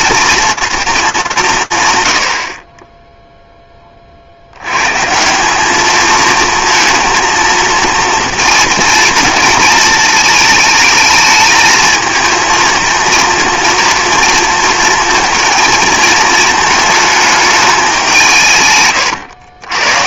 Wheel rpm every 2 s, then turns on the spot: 220, 30, 120, 230, 230, 220, 230, 230, 220, 140.
none